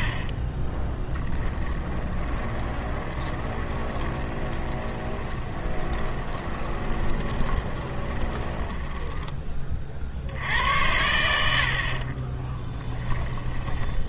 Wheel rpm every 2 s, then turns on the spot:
10, 10, 20, 20, 20, 80, 10.
0-10 12-14